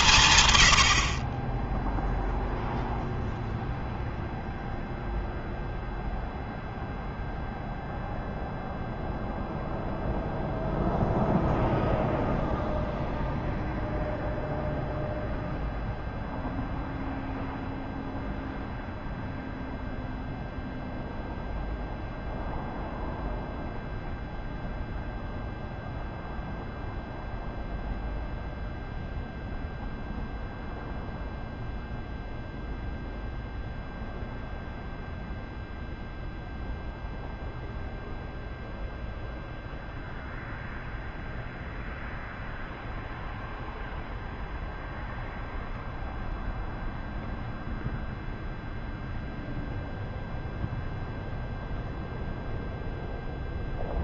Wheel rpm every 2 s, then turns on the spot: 140, 0, 0, 0, 0, 0, 0, 0, 0, 0, 0, 0, 0, 0, 0, 0, 0, 0, 0, 0, 0, 0, 0, 0, 0, 0, 0.
none